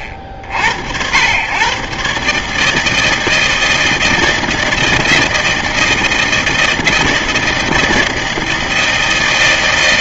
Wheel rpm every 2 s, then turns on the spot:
80, 150, 160, 160, 160.
none